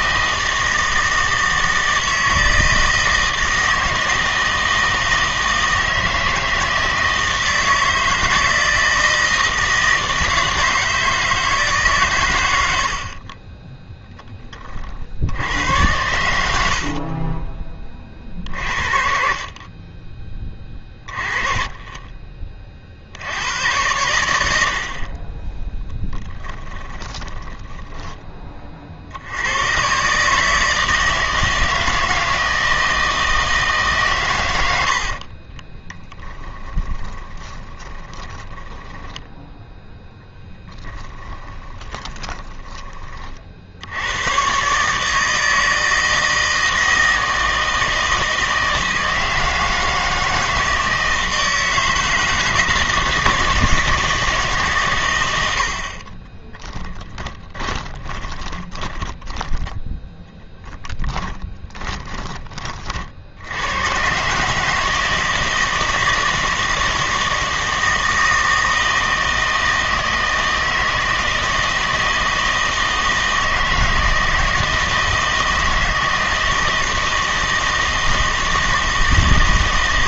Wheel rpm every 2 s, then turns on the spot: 160, 160, 160, 160, 160, 160, 80, 30, 50, 50, 20, 40, 70, 10, 40, 160, 160, 90, 20, 10, 10, 20, 130, 160, 160, 160, 160, 130, 10, 10, 10, 40, 160, 160, 160, 160, 160, 160, 160, 160.
16-18 26-28 36-38 40-42 56-62